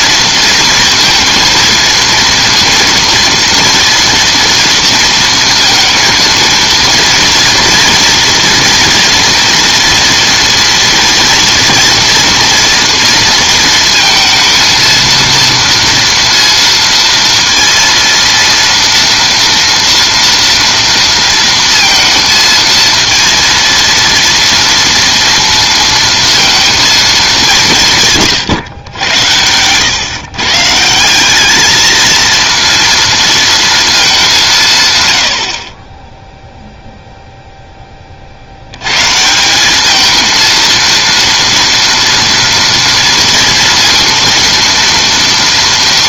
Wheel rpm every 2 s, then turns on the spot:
230, 230, 230, 230, 230, 230, 230, 230, 230, 230, 230, 230, 230, 220, 120, 160, 230, 120, 0, 110, 230, 230, 230.
none